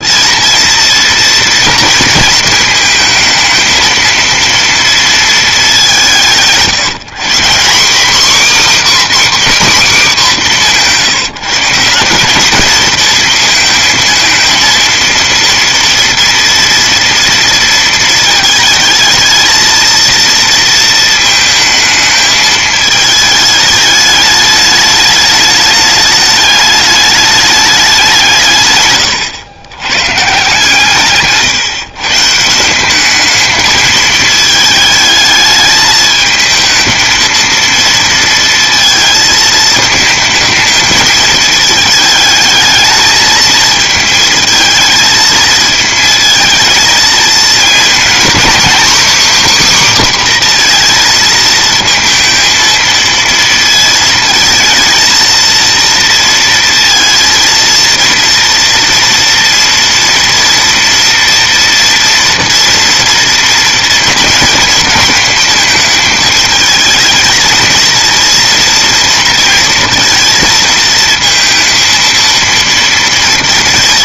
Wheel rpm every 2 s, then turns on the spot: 230, 220, 230, 160, 280, 210, 220, 230, 230, 220, 230, 220, 210, 210, 140, 150, 180, 220, 220, 230, 220, 220, 220, 220, 260, 250, 230, 220, 230, 230, 230, 230, 220, 220, 230, 230, 230.
none